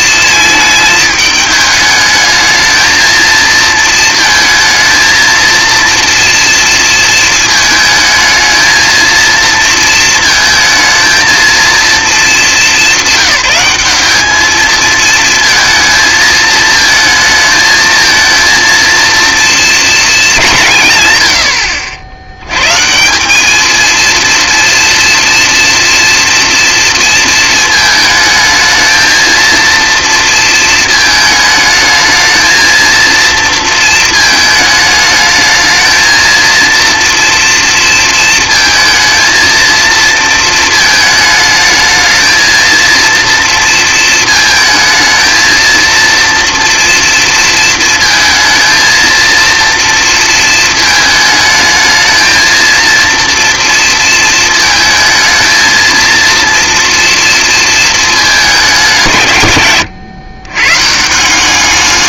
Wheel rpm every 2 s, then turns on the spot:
220, 220, 230, 230, 230, 220, 200, 220, 220, 230, 160, 140, 230, 230, 220, 220, 230, 210, 230, 220, 230, 230, 220, 230, 230, 220, 230, 220, 230, 190, 110.
none